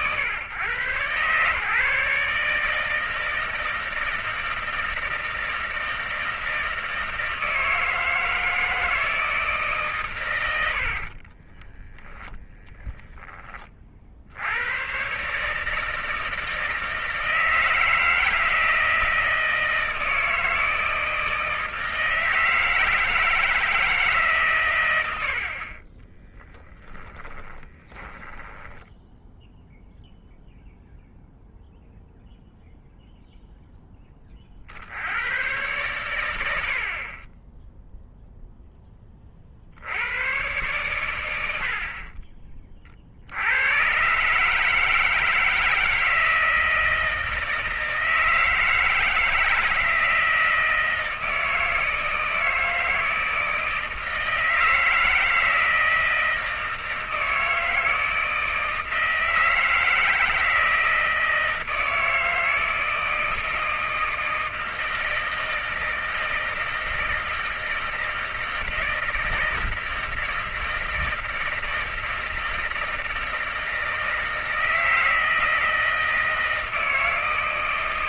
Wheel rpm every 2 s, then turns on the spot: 120, 150, 160, 160, 160, 100, 10, 70, 160, 160, 160, 160, 140, 30, 20, 0, 0, 30, 90, 0, 100, 50, 130, 160, 160, 160, 160, 160, 160, 160, 160, 160, 160, 160, 160, 160, 160, 160, 160.
10-12 26-30 42-44